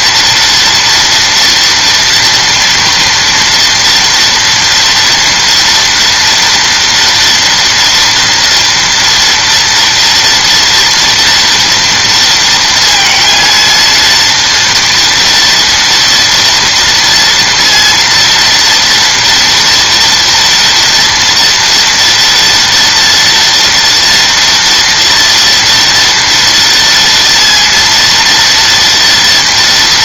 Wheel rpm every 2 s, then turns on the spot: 230, 230, 230, 230, 230, 230, 230, 230, 230, 230, 240, 230, 230, 240, 230.
none